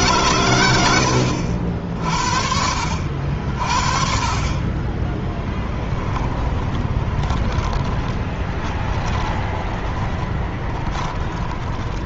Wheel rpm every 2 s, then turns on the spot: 110, 70, 20, 20, 30, 20.
6-12